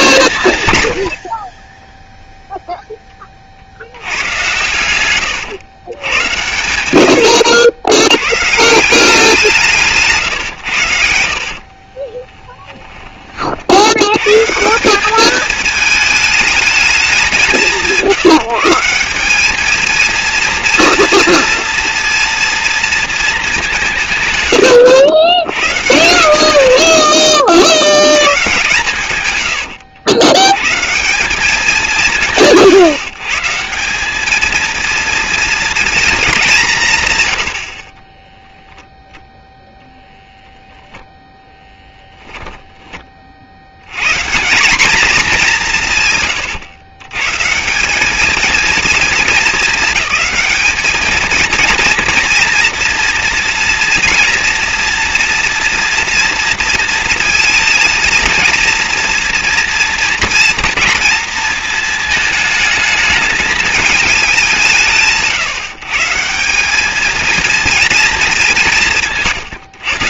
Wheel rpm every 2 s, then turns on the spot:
110, 0, 120, 100, 160, 100, 10, 160, 210, 160, 230, 230, 100, 90, 120, 130, 160, 220, 210, 0, 0, 20, 190, 120, 220, 220, 230, 230, 230, 230, 230, 220, 170, 200, 190.
4-6 12-14 26-28